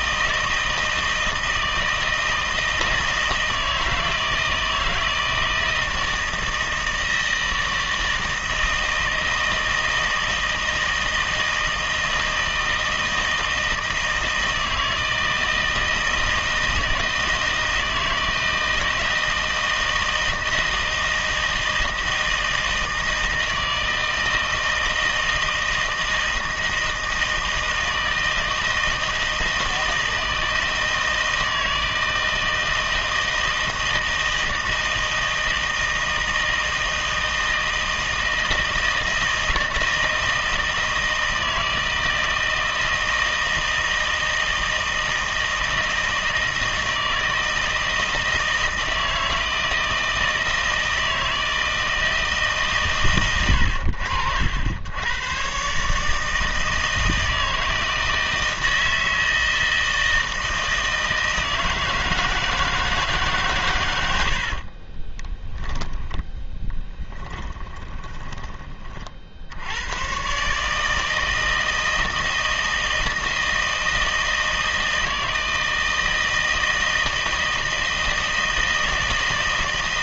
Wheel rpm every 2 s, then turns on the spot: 160, 160, 160, 160, 160, 160, 160, 160, 160, 160, 160, 160, 160, 160, 160, 160, 160, 160, 160, 160, 160, 160, 160, 160, 160, 160, 150, 80, 160, 160, 160, 160, 50, 20, 20, 140, 160, 160, 160, 160.
64-68